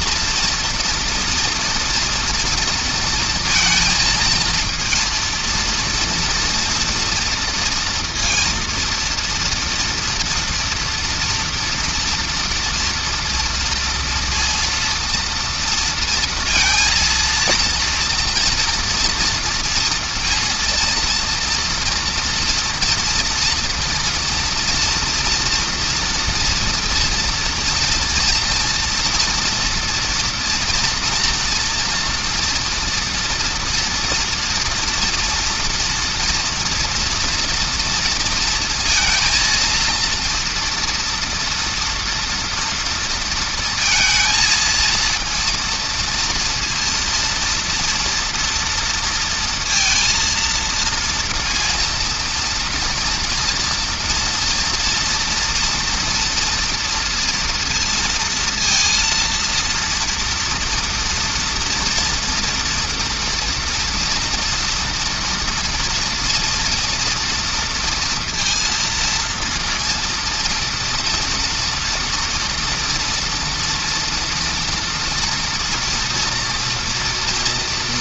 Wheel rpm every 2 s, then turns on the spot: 230, 240, 230, 230, 230, 230, 240, 230, 230, 230, 230, 230, 230, 230, 230, 240, 230, 230, 240, 230, 230, 230, 220, 230, 230, 230, 230, 230, 230, 230, 230, 230, 230, 230, 230, 230, 230, 230, 240.
none